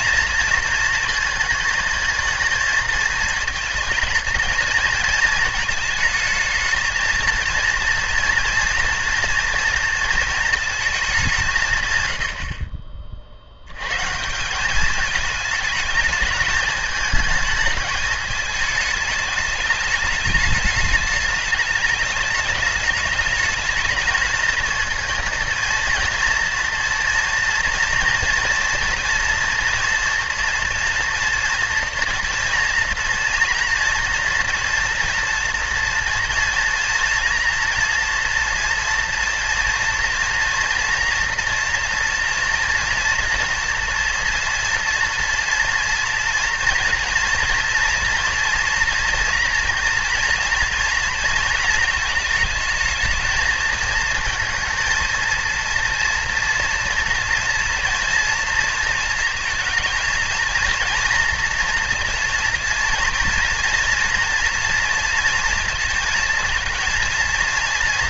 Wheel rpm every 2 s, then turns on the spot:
230, 220, 230, 220, 230, 220, 50, 200, 220, 210, 210, 210, 230, 230, 230, 240, 230, 230, 240, 230, 230, 230, 230, 230, 240, 230, 220, 220, 230, 230, 230, 230, 230, 230.
none